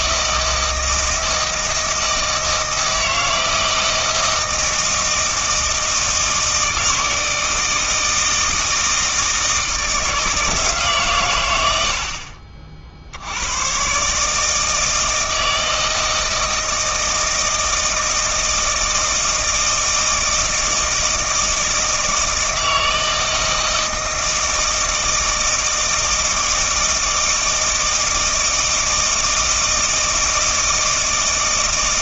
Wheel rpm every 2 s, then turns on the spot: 160, 160, 160, 160, 160, 150, 50, 160, 160, 160, 160, 160, 160, 160, 160, 160.
none